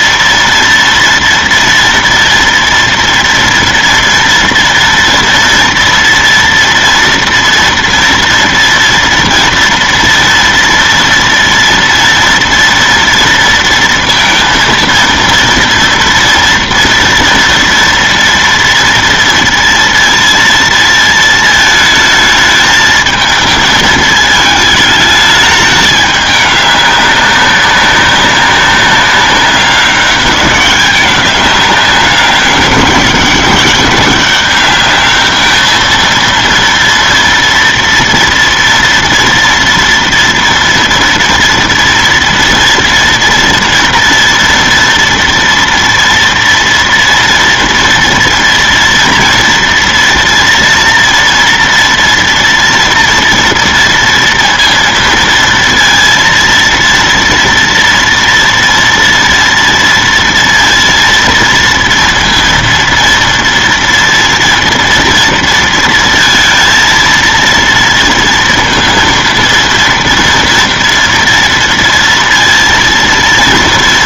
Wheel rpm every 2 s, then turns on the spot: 230, 230, 230, 240, 230, 230, 230, 230, 230, 230, 230, 220, 220, 210, 200, 200, 200, 200, 230, 230, 230, 230, 230, 230, 230, 230, 230, 230, 230, 230, 230, 230, 230, 230, 230, 230, 230.
none